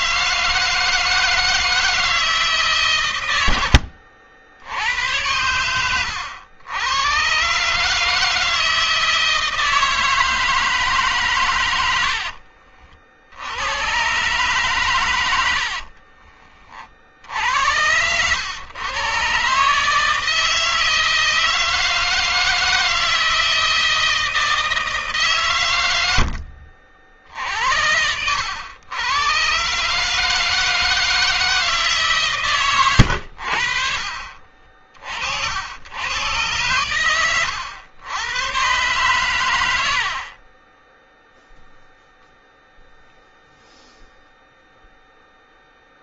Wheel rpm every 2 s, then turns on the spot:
160, 130, 80, 110, 160, 150, 60, 120, 40, 120, 160, 160, 150, 50, 110, 160, 110, 40, 110, 120, 10, 0, 0.
32-34